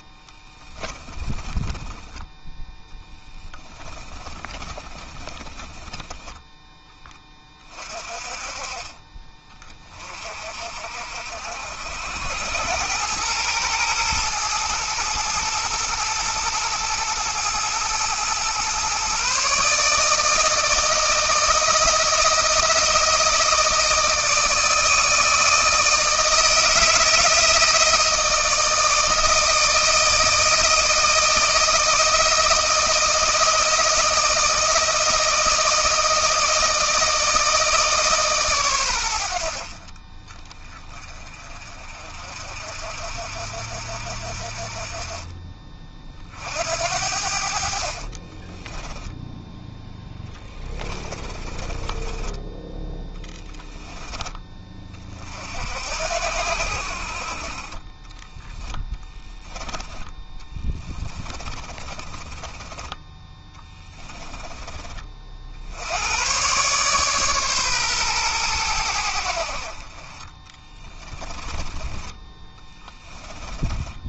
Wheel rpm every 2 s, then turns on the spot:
20, 10, 20, 20, 40, 60, 100, 110, 110, 130, 160, 170, 160, 160, 160, 160, 160, 160, 160, 100, 30, 50, 30, 60, 0, 20, 10, 40, 50, 10, 20, 20, 40, 140, 90, 20, 20.
0-2 4-6 50-52 60-64 70-74